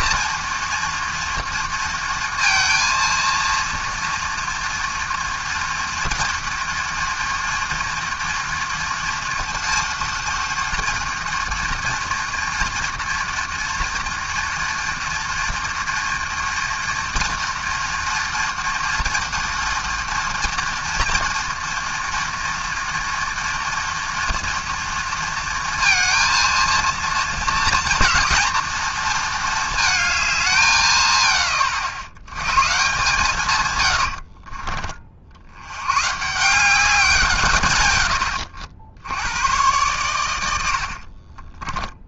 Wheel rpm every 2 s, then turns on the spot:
230, 230, 240, 230, 230, 230, 230, 230, 230, 230, 230, 230, 230, 230, 230, 140, 130, 70, 160, 100, 40.
40-42